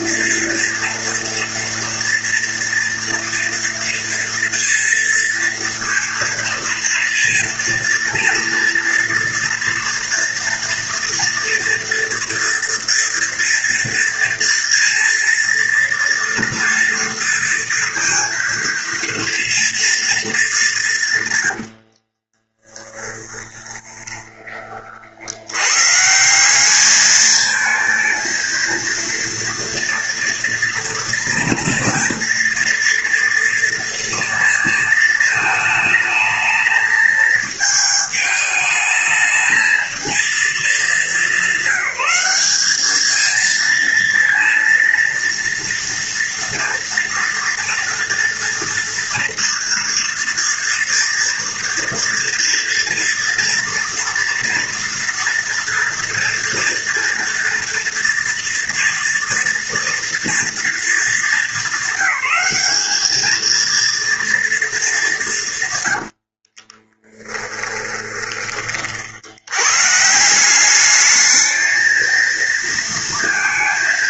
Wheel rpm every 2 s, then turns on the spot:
230, 230, 230, 230, 240, 230, 230, 230, 230, 230, 130, 10, 80, 220, 230, 240, 230, 220, 220, 220, 200, 220, 230, 230, 230, 230, 240, 230, 230, 230, 210, 220, 190, 10, 70, 210, 230.
22-24 66-68